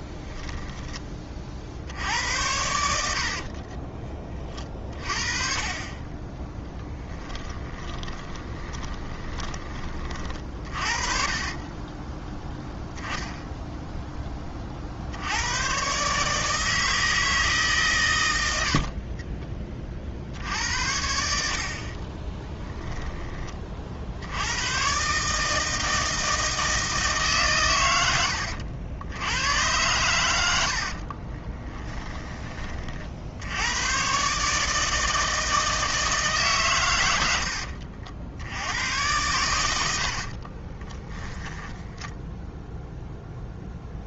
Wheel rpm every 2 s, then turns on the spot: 10, 70, 30, 10, 20, 50, 0, 40, 160, 60, 80, 10, 110, 160, 100, 60, 40, 160, 120, 90, 20, 0.
2-4 6-12 18-20 22-24 30-32 40-42